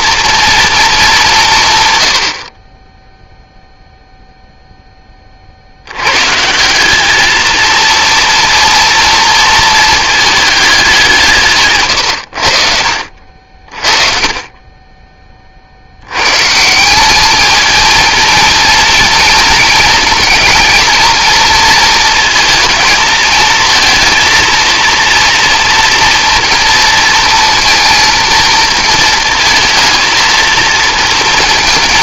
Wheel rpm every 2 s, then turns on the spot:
230, 40, 0, 170, 240, 210, 80, 30, 150, 230, 230, 230, 230, 230, 230, 220.
none